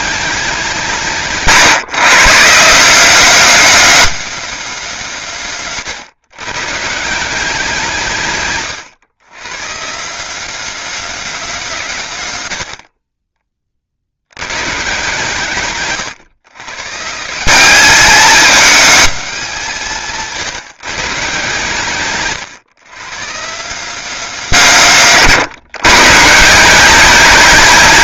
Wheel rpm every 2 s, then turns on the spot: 160, 190, 190, 160, 120, 210, 40, 140, 160, 220, 150, 140, 160, 180.
none